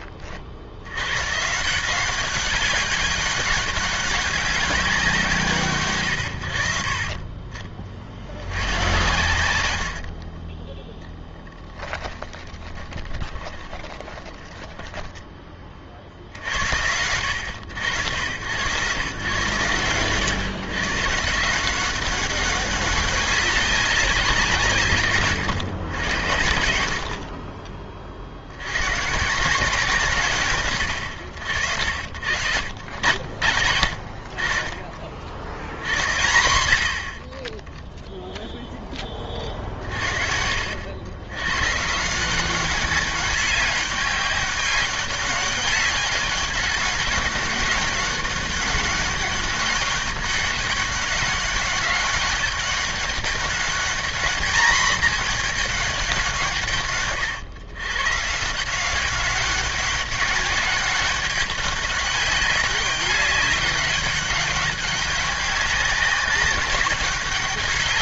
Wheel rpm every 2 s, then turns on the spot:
60, 190, 190, 70, 90, 10, 20, 20, 70, 120, 140, 200, 170, 80, 80, 140, 80, 40, 80, 0, 70, 190, 200, 190, 190, 200, 200, 220, 130, 170, 200, 200, 200, 190.
12-16